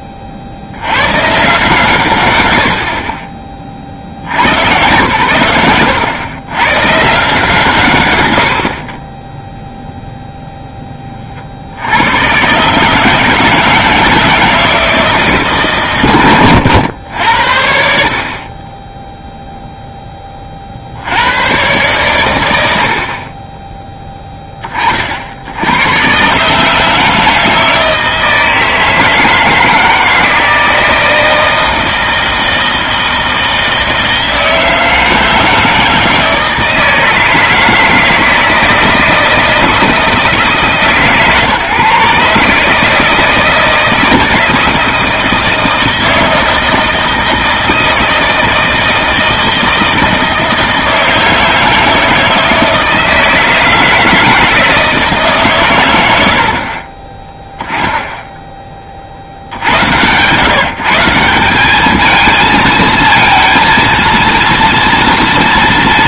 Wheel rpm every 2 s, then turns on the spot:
70, 40, 130, 120, 20, 10, 130, 160, 120, 10, 70, 20, 40, 160, 160, 160, 160, 160, 160, 160, 150, 160, 160, 160, 160, 160, 160, 160, 30, 0, 150, 220, 230.
none